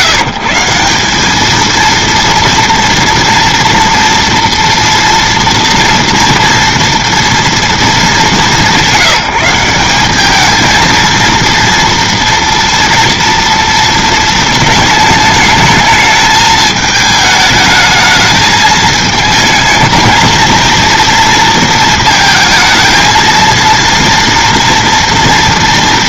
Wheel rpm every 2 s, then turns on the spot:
170, 230, 230, 230, 190, 220, 230, 220, 220, 220, 230, 230, 230.
none